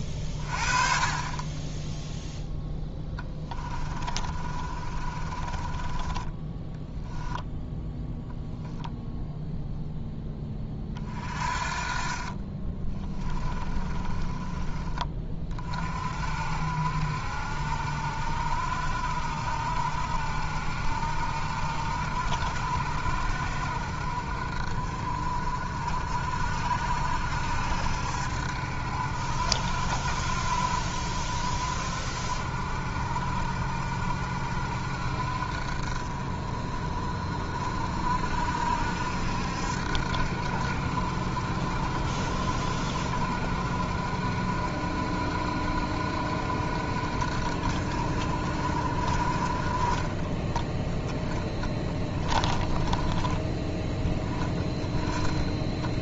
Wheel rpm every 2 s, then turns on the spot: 30, 10, 30, 10, 0, 30, 20, 20, 60, 70, 70, 70, 50, 60, 70, 70, 60, 60, 40, 60, 60, 60, 60, 60, 50, 10, 20, 10.
2-8 12-14